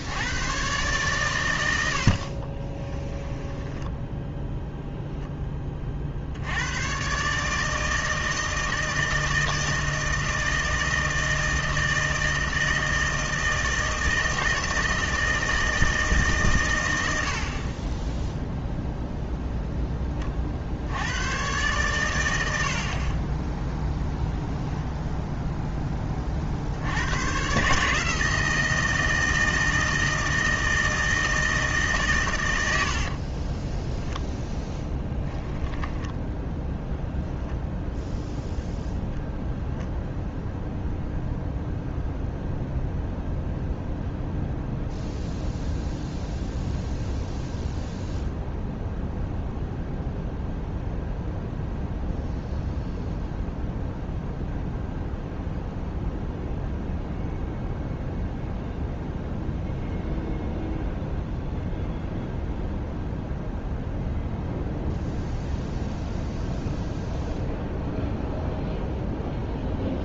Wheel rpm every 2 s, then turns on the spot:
120, 20, 10, 110, 160, 160, 160, 160, 110, 0, 70, 50, 0, 80, 160, 160, 80, 10, 0, 0, 0, 0, 0, 0, 0, 0, 0, 0, 0, 0, 0, 0, 0, 0, 0.
2-4 32-34